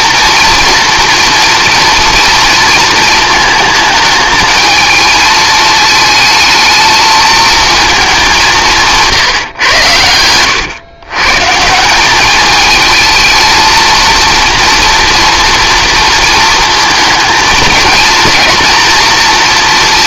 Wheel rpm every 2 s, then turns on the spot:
230, 230, 220, 220, 180, 110, 210, 230, 230, 230.
none